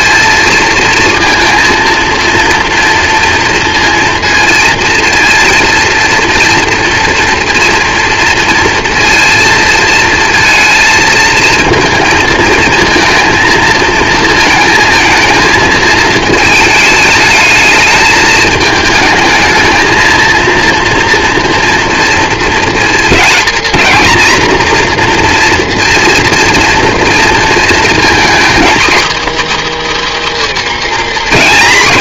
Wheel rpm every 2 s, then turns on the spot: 230, 230, 230, 230, 230, 230, 230, 220, 220, 220, 230, 230, 240, 230, 270, 280.
none